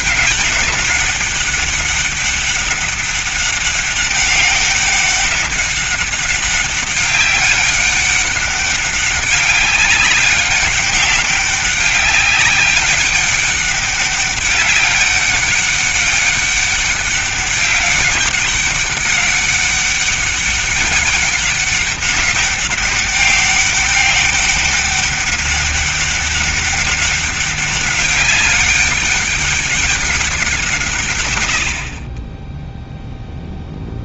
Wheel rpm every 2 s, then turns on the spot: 200, 200, 200, 200, 200, 200, 200, 200, 200, 200, 200, 200, 200, 200, 200, 160, 0.
none